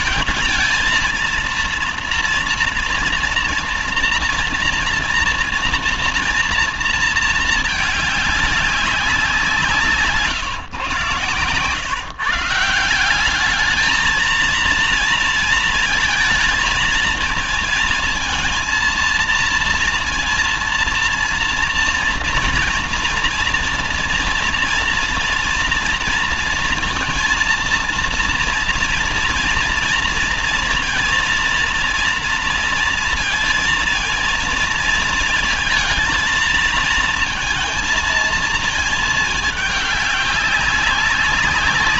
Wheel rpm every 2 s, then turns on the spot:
220, 230, 230, 230, 200, 130, 160, 230, 230, 230, 230, 230, 230, 230, 230, 230, 230, 230, 230, 220, 200.
none